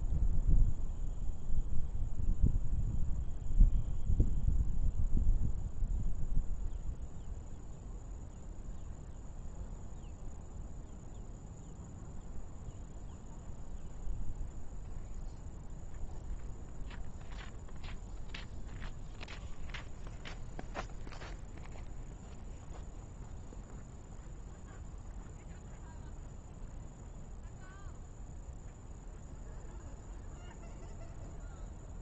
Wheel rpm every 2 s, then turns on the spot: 0, 0, 0, 0, 0, 0, 0, 0, 0, 0, 0, 0, 0, 0, 0, 0.
none